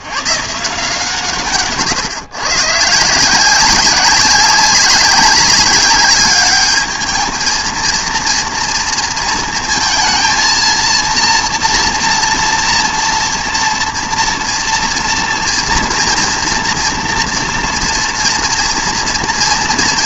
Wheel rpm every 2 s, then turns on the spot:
150, 140, 190, 210, 230, 230, 230, 230, 240, 230.
none